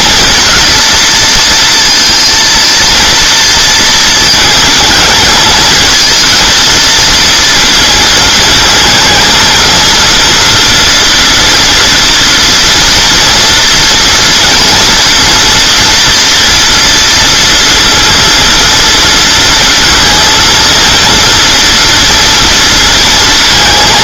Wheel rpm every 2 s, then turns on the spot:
220, 230, 220, 220, 220, 230, 230, 230, 230, 230, 230, 230.
none